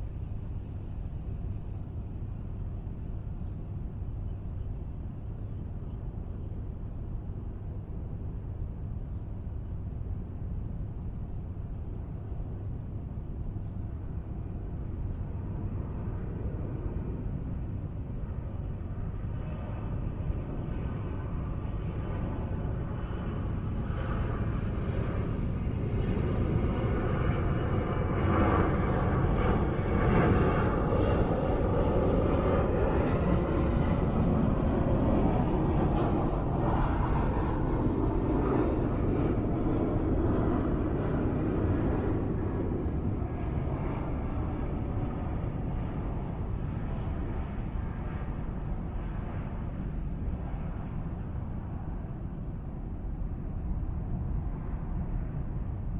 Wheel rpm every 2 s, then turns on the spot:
0, 0, 0, 0, 0, 0, 0, 0, 0, 0, 0, 0, 0, 0, 0, 0, 0, 0, 0, 0, 0, 0, 0, 0, 0, 0, 0, 0.
none